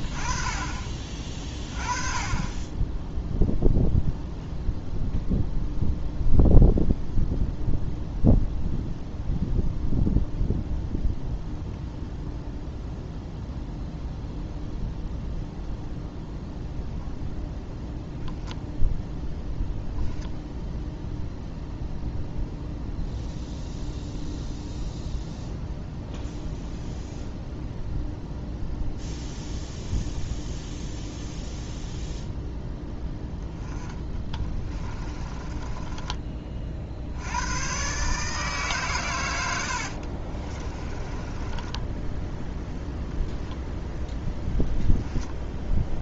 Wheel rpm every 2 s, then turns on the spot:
30, 20, 0, 0, 0, 0, 0, 0, 0, 0, 0, 0, 0, 0, 0, 0, 0, 20, 50, 140, 30, 0, 0.
34-36 40-42